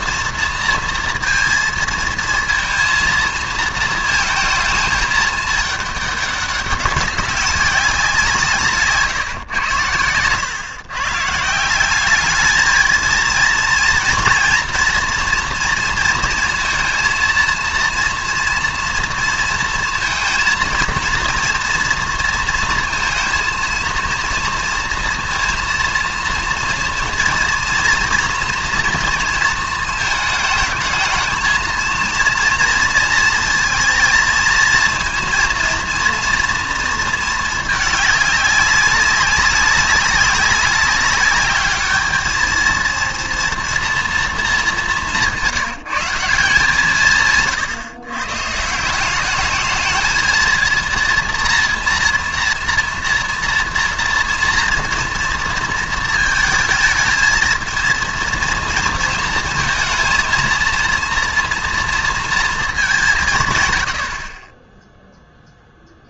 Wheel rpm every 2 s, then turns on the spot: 230, 230, 220, 200, 150, 120, 220, 230, 230, 230, 230, 230, 230, 230, 230, 220, 230, 230, 230, 200, 200, 220, 200, 160, 160, 230, 230, 230, 220, 230, 230, 210, 10.
none